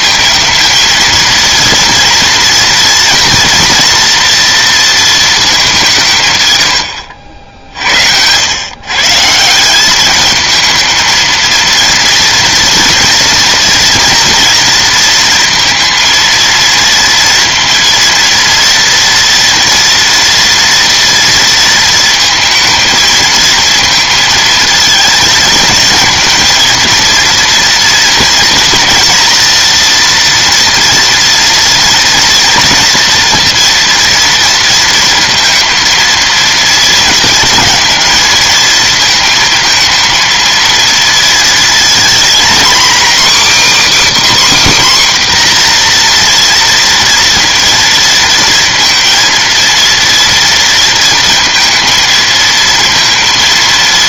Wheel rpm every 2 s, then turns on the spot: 230, 230, 230, 110, 130, 220, 230, 230, 230, 230, 230, 220, 220, 230, 230, 230, 230, 230, 230, 230, 230, 250, 280, 230, 230, 230, 230.
none